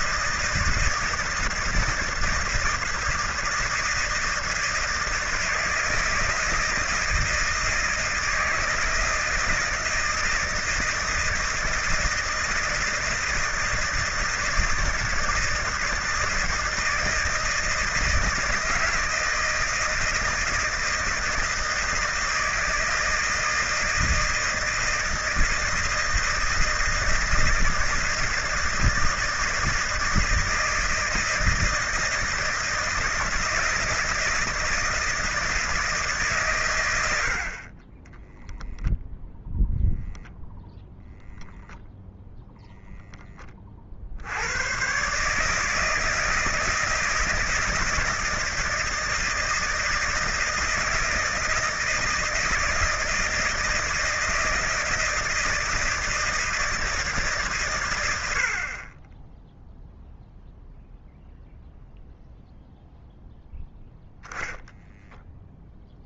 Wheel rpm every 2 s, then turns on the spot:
160, 160, 160, 160, 160, 160, 160, 160, 160, 160, 160, 160, 160, 160, 160, 160, 160, 160, 130, 0, 0, 0, 100, 160, 160, 160, 160, 160, 160, 80, 0, 0, 0.
none